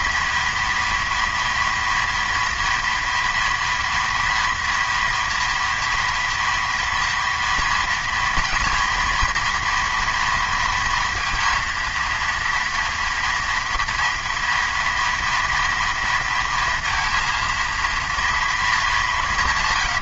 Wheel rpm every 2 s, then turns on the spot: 230, 230, 230, 230, 240, 230, 230, 230, 230, 230.
none